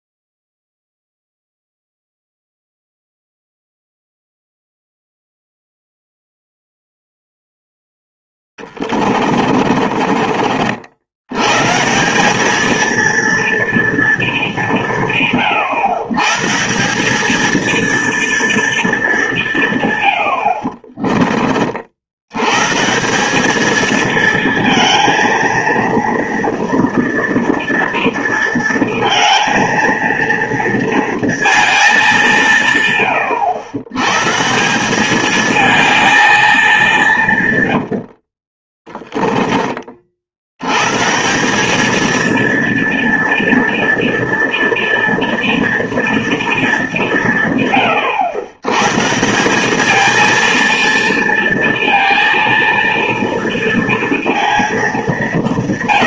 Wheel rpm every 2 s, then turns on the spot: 0, 0, 0, 0, 20, 60, 220, 190, 170, 230, 60, 140, 230, 230, 230, 230, 150, 180, 210, 30, 110, 230, 230, 210, 130, 230, 230, 220.
8-10 20-22 38-40